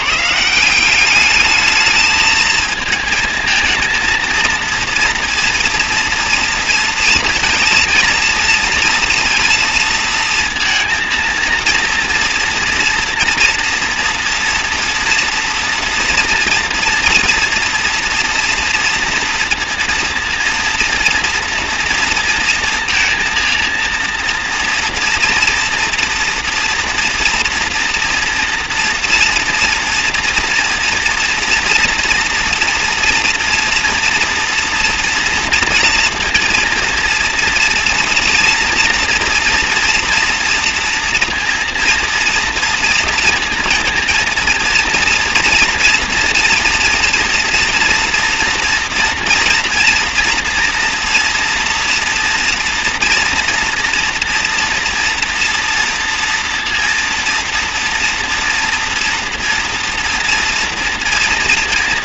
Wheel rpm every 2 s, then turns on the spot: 170, 220, 230, 230, 230, 230, 230, 230, 230, 240, 230, 230, 230, 230, 230, 230, 240, 230, 230, 240, 230, 230, 230, 230, 230, 230, 230, 240, 240, 230, 240.
none